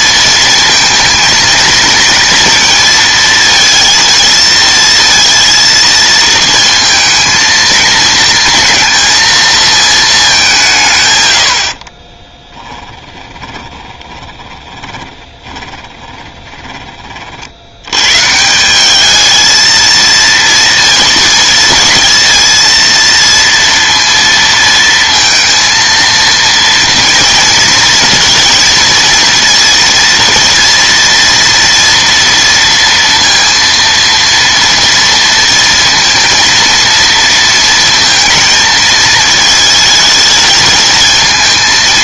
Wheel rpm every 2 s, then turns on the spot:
230, 230, 230, 220, 230, 140, 10, 20, 20, 180, 230, 230, 230, 230, 230, 230, 230, 230, 230, 220, 220.
12-16